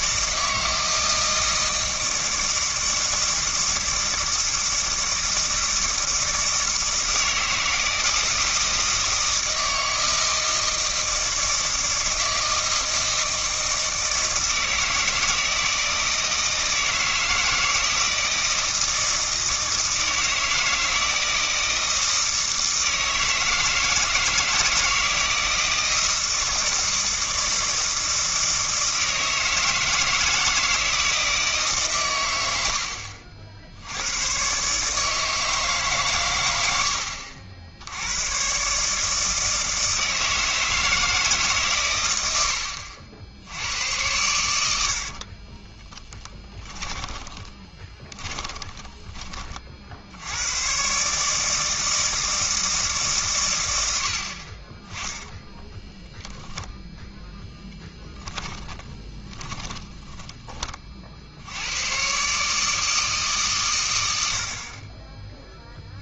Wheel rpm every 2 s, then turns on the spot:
160, 160, 160, 160, 160, 160, 160, 160, 160, 160, 160, 160, 160, 160, 160, 160, 80, 140, 80, 150, 160, 80, 70, 20, 20, 130, 160, 20, 0, 10, 40, 160, 30.
42-44 46-50 58-60